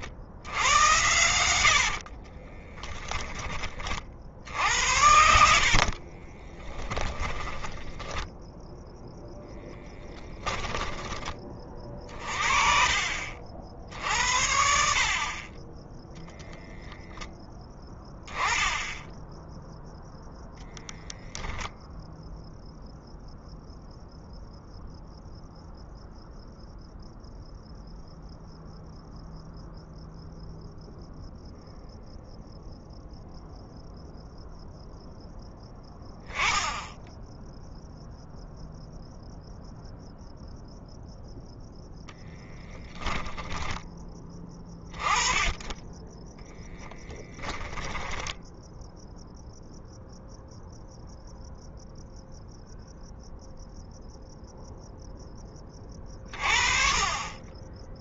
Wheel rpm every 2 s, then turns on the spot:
90, 20, 80, 10, 0, 20, 50, 50, 0, 0, 0, 0, 0, 0, 0, 0, 0, 0, 10, 0, 0, 10, 20, 10, 0, 0, 0, 0, 30.
2-8